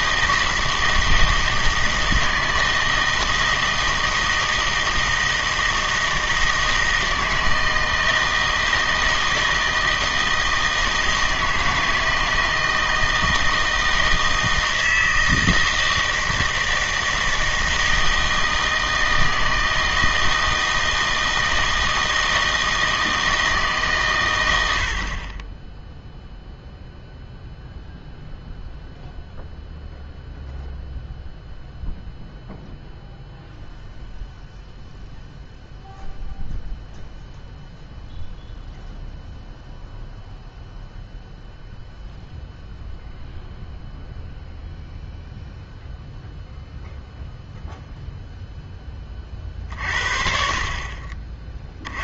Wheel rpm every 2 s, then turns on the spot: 160, 160, 160, 160, 160, 160, 160, 160, 160, 160, 160, 160, 80, 0, 0, 0, 0, 0, 0, 0, 0, 0, 0, 0, 10, 40.
none